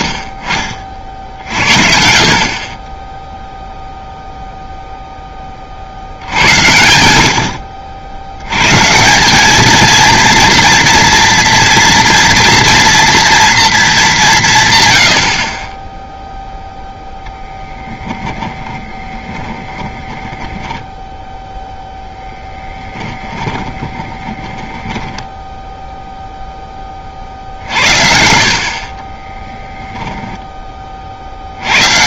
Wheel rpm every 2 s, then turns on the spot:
50, 40, 0, 80, 130, 230, 230, 130, 0, 20, 10, 10, 20, 20, 60, 20.
18-26 28-30